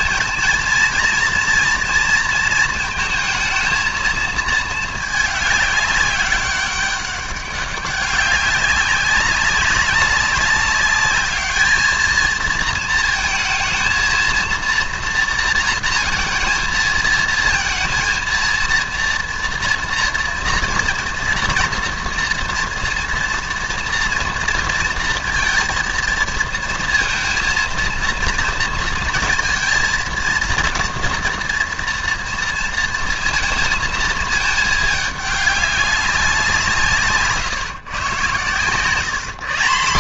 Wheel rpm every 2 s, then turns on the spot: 230, 230, 220, 200, 200, 200, 220, 230, 230, 230, 230, 230, 230, 230, 230, 230, 230, 210, 180, 130.
none